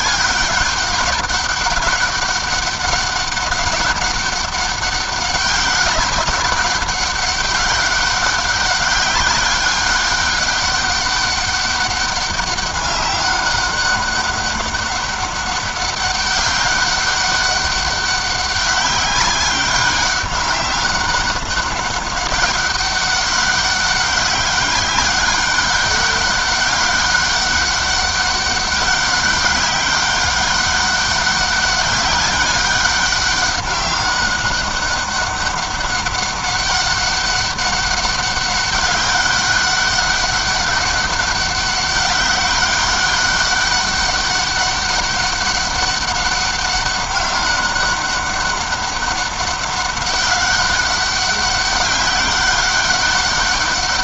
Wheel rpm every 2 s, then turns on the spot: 200, 200, 200, 190, 200, 200, 200, 200, 200, 200, 200, 200, 200, 200, 190, 190, 190, 200, 200, 200, 200, 200, 200, 200, 200, 200, 200.
none